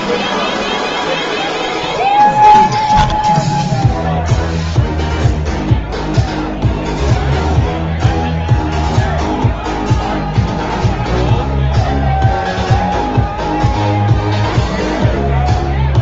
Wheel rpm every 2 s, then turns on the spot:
10, 0, 0, 0, 0, 0, 0, 0.
none